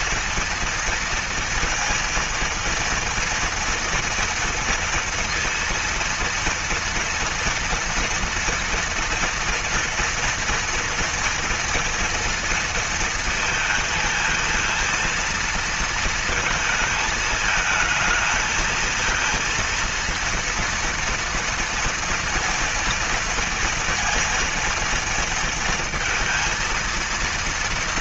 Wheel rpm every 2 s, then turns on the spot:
230, 230, 230, 230, 230, 230, 230, 220, 220, 220, 230, 230, 230, 230.
none